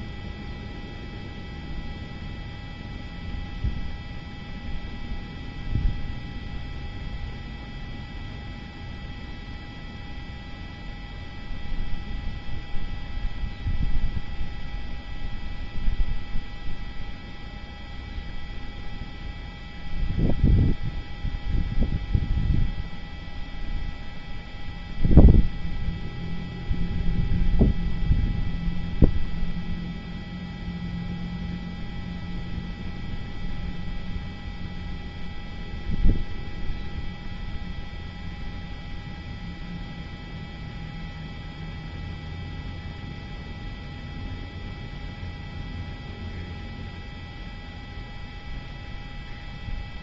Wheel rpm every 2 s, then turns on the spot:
0, 0, 0, 0, 0, 0, 0, 0, 0, 0, 0, 0, 0, 0, 0, 0, 0, 0, 0, 0, 0, 0, 0, 0, 0.
none